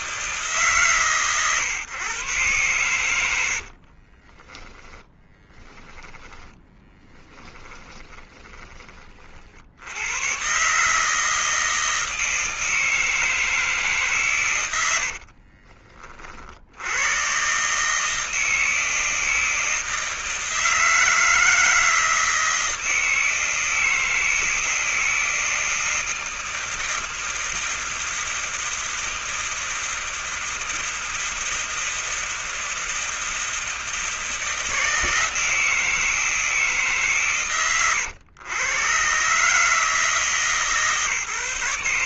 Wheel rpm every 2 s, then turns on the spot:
150, 120, 30, 10, 10, 120, 160, 130, 50, 160, 160, 160, 160, 160, 160, 160, 160, 160, 160, 110, 150.
4-8